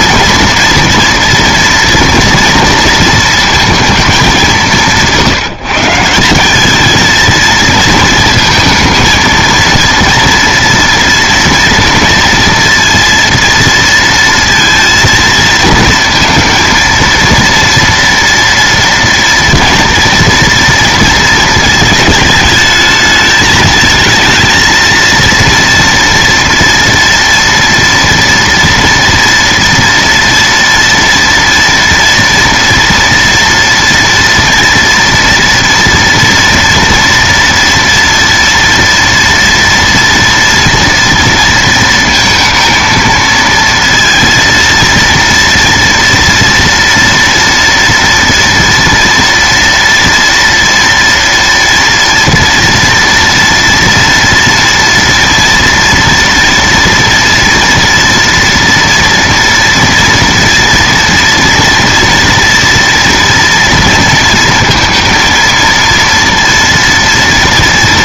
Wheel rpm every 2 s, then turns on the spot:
230, 230, 190, 190, 220, 230, 230, 230, 230, 230, 230, 220, 230, 230, 230, 230, 240, 230, 240, 230, 230, 230, 230, 230, 230, 230, 240, 230, 230, 230, 230, 230, 230, 230.
none